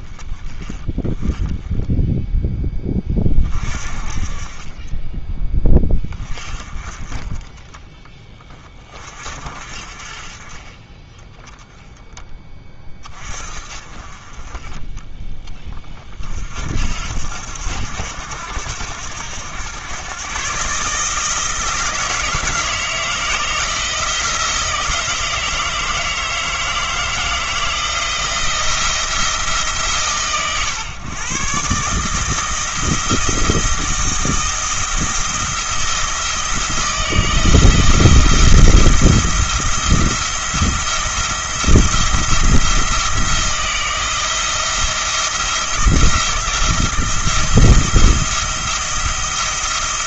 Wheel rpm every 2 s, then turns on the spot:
20, 10, 20, 30, 30, 20, 20, 30, 60, 80, 140, 160, 160, 160, 170, 120, 160, 170, 170, 170, 170, 170, 170, 170, 170.
none